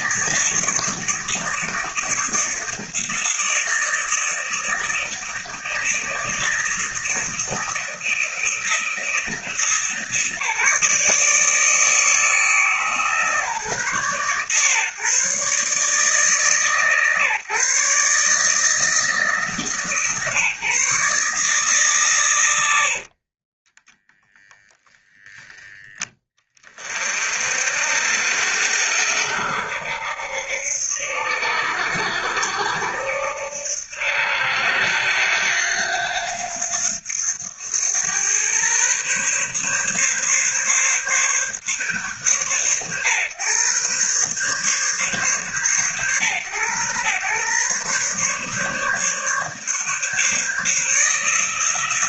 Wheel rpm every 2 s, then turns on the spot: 160, 160, 160, 160, 170, 160, 150, 130, 140, 160, 150, 80, 0, 30, 70, 70, 70, 80, 90, 130, 140, 120, 140, 120, 140, 160.
22-24